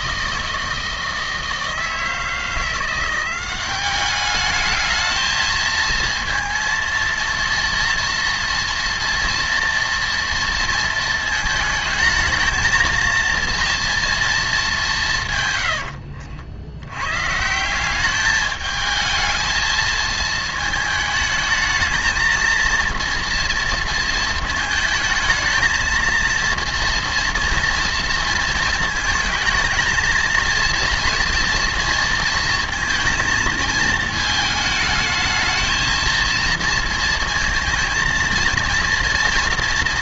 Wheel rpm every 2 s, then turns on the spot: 160, 170, 210, 230, 230, 230, 220, 200, 70, 220, 220, 230, 220, 230, 230, 230, 230, 220, 230, 230.
none